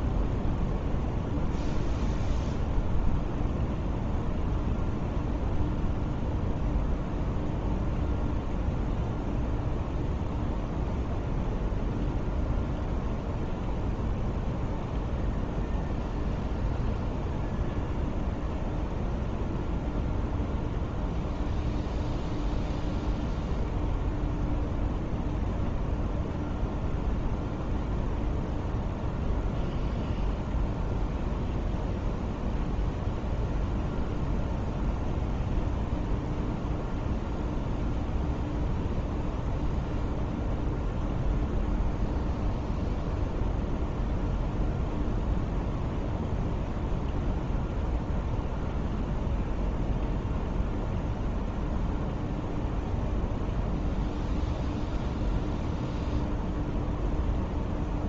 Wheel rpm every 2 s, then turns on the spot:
0, 0, 0, 0, 0, 0, 0, 0, 0, 0, 0, 0, 0, 0, 0, 0, 0, 0, 0, 0, 0, 0, 0, 0, 0, 0, 0, 0, 0.
none